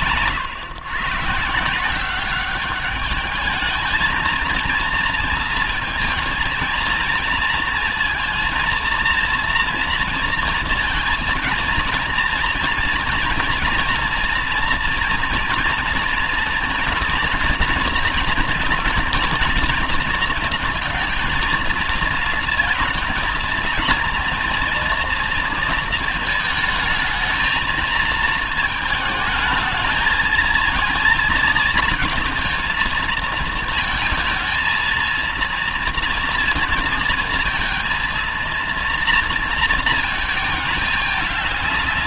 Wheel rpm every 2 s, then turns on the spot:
120, 200, 230, 230, 230, 230, 230, 240, 230, 230, 230, 230, 230, 220, 220, 220, 220, 230, 230, 230, 220.
none